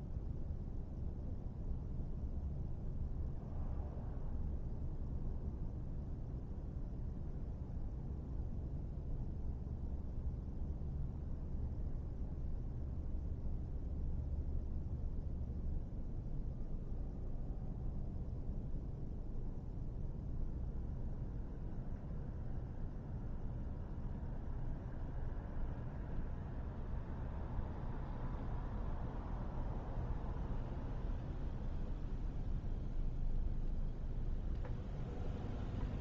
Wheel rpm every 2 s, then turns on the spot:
0, 0, 0, 0, 0, 0, 0, 0, 0, 0, 0, 0, 0, 0, 0, 0, 0, 0.
none